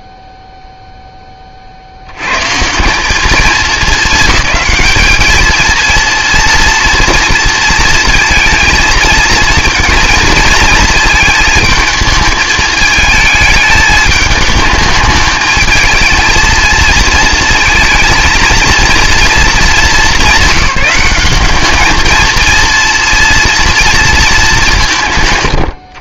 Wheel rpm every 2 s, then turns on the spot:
0, 160, 210, 230, 230, 220, 220, 220, 230, 230, 190, 230, 190.
none